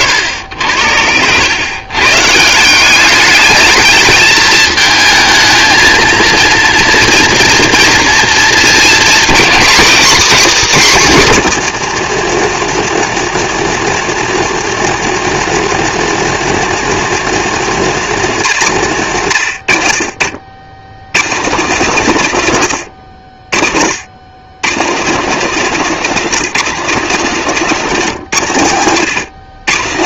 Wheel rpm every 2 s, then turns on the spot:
80, 180, 220, 230, 240, 260, 220, 230, 240, 170, 80, 130, 150, 220, 140.
none